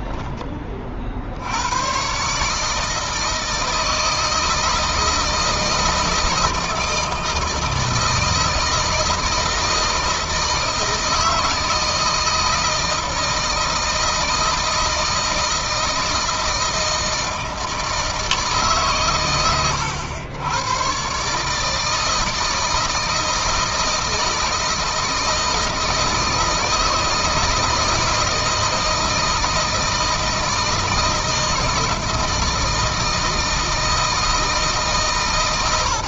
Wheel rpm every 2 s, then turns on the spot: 30, 150, 160, 160, 160, 160, 160, 160, 160, 150, 110, 160, 160, 160, 160, 160, 160, 160.
none